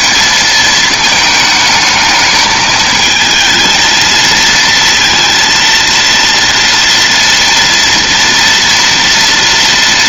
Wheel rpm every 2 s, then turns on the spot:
220, 220, 230, 230, 230.
none